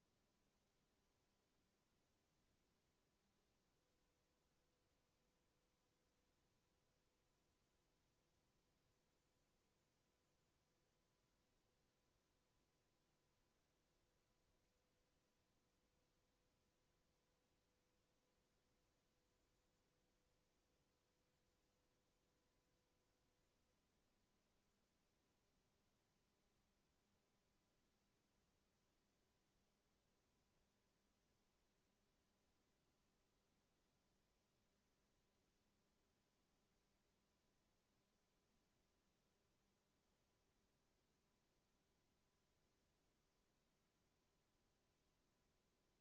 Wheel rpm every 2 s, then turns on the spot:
0, 0, 0, 0, 0, 0, 0, 0, 0, 0, 0, 0, 0, 0, 0, 0, 0, 0, 0, 0, 0, 0, 0.
none